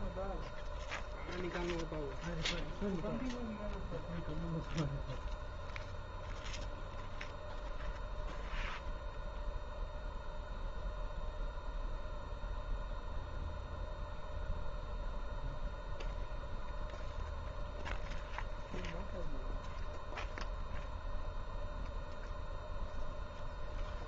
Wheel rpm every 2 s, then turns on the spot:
0, 0, 0, 0, 0, 0, 0, 0, 0, 0, 0, 0.
none